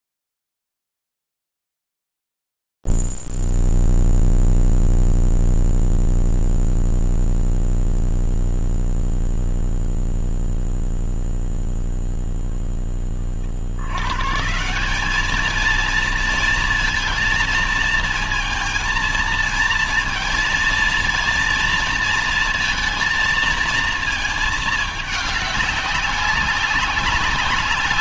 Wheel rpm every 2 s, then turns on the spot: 0, 0, 0, 0, 0, 0, 0, 140, 220, 220, 230, 230, 220, 190.
none